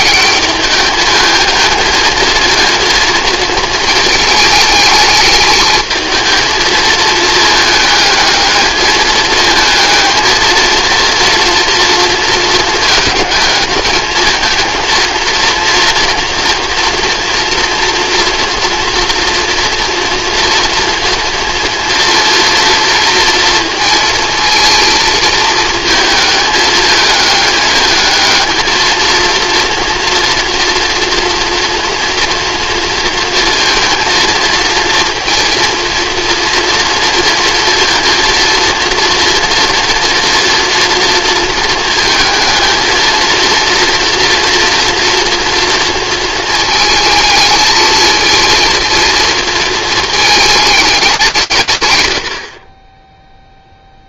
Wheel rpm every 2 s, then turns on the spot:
210, 230, 220, 220, 220, 230, 230, 230, 240, 230, 230, 230, 230, 220, 220, 230, 230, 230, 230, 230, 230, 230, 230, 220, 230, 220, 40.
none